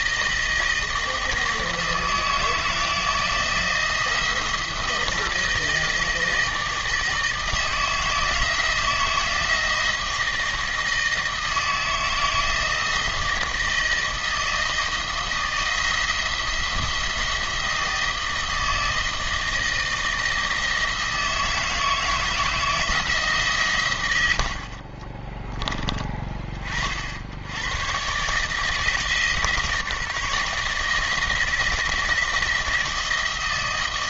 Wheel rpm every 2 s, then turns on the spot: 160, 160, 160, 160, 160, 160, 160, 160, 170, 160, 160, 160, 50, 40, 160, 160, 160.
24-26